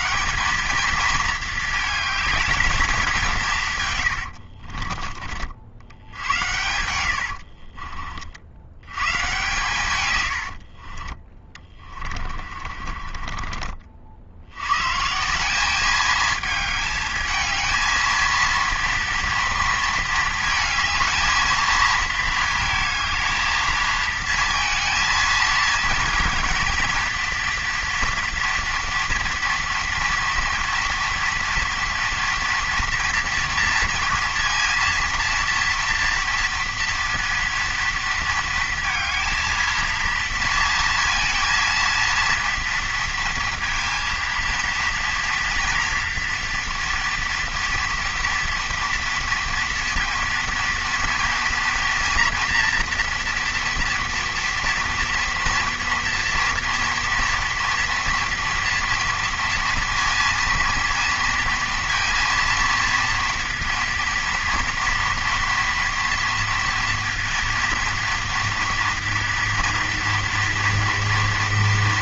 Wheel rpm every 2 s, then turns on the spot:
220, 220, 60, 90, 90, 60, 40, 90, 220, 230, 220, 220, 230, 230, 230, 230, 230, 230, 230, 230, 230, 230, 230, 240, 230, 230, 230, 240, 230, 230, 230, 230, 230, 230, 240, 230.
4-8 10-14